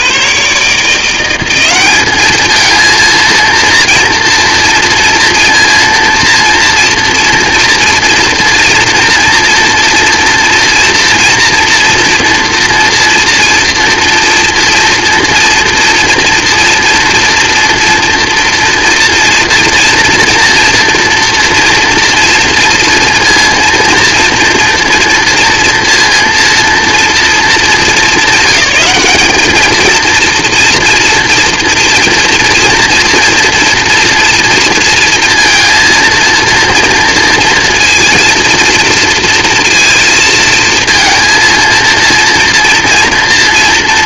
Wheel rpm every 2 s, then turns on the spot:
120, 210, 230, 230, 240, 230, 230, 230, 230, 230, 230, 230, 230, 230, 200, 230, 230, 230, 230, 230, 230, 230.
none